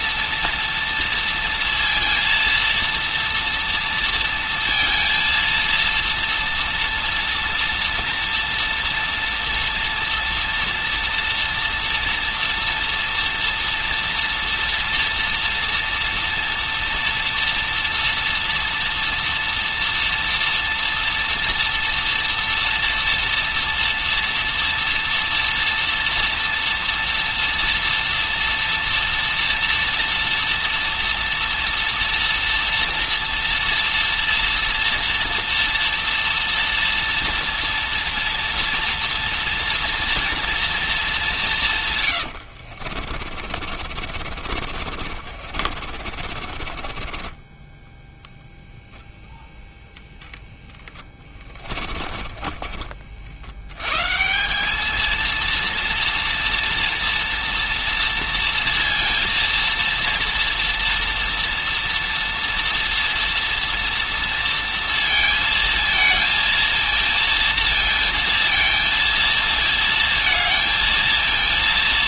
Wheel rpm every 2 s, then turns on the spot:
230, 230, 230, 240, 240, 230, 230, 230, 230, 230, 230, 230, 230, 230, 230, 230, 230, 230, 230, 230, 230, 70, 40, 30, 0, 10, 30, 200, 230, 230, 230, 230, 230, 230, 230, 230.
42-48 50-52